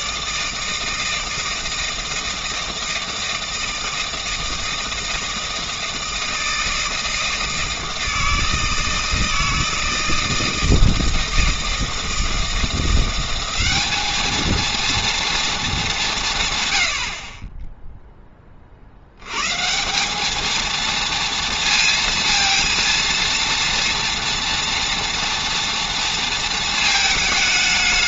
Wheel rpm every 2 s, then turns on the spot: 160, 160, 160, 160, 160, 160, 170, 230, 120, 50, 230, 230, 230, 220.
none